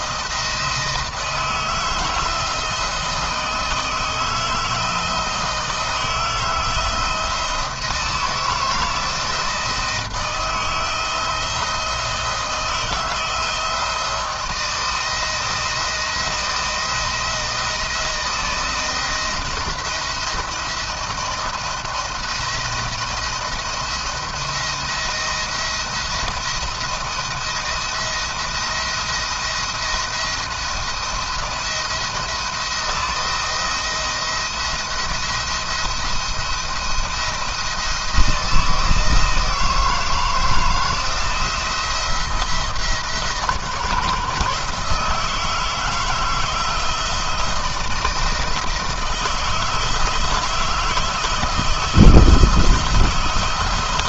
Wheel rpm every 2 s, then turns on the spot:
160, 160, 160, 160, 160, 160, 160, 170, 170, 170, 170, 170, 170, 170, 170, 170, 170, 170, 170, 160, 160, 160, 150, 160, 160, 160, 160.
none